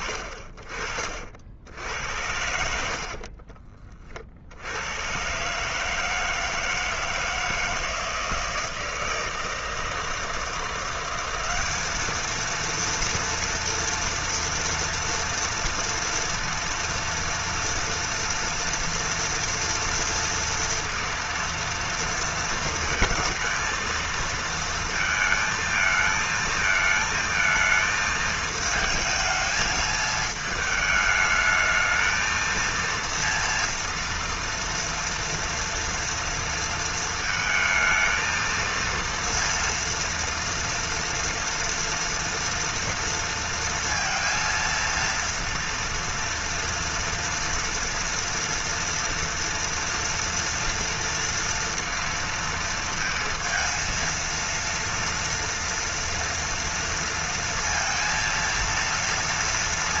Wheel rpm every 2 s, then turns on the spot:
50, 70, 90, 160, 160, 180, 230, 230, 230, 230, 230, 230, 230, 220, 220, 220, 230, 230, 230, 230, 230, 240, 230, 230, 240, 240, 230, 230, 230, 230.
2-4